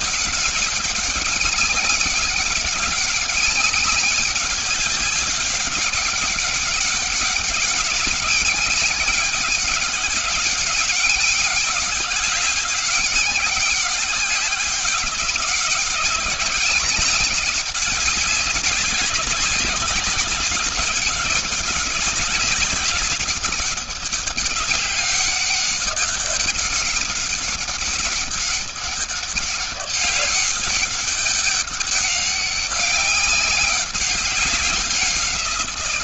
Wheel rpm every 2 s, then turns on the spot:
200, 200, 190, 190, 200, 200, 190, 200, 200, 200, 200, 200, 200, 200, 200, 200, 200, 190.
none